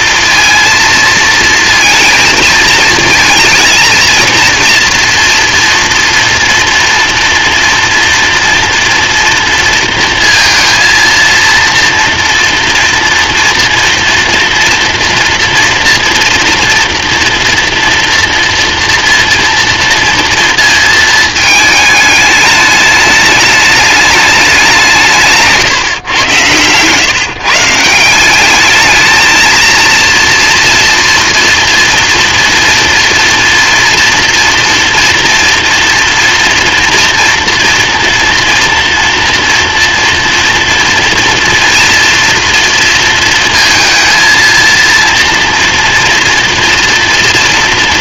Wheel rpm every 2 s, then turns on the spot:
230, 220, 230, 240, 230, 230, 230, 230, 230, 230, 220, 210, 150, 140, 230, 230, 240, 230, 230, 230, 230, 230, 240, 230.
none